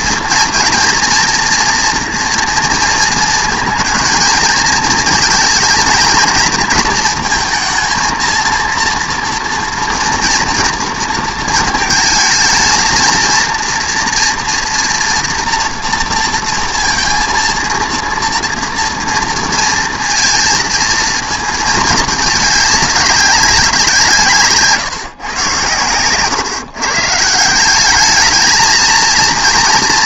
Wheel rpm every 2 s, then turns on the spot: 230, 230, 220, 230, 230, 230, 230, 230, 230, 230, 230, 210, 140, 140, 230.
none